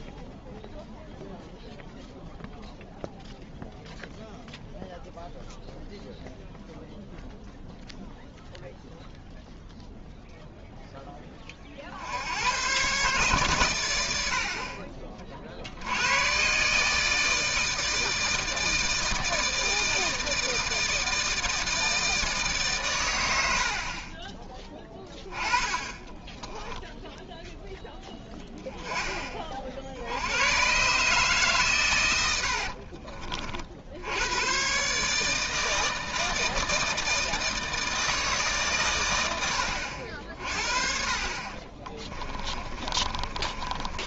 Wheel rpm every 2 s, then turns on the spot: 0, 0, 0, 0, 0, 0, 110, 40, 150, 160, 160, 130, 20, 10, 10, 130, 60, 120, 160, 130, 50, 30.
26-28 32-34 42-44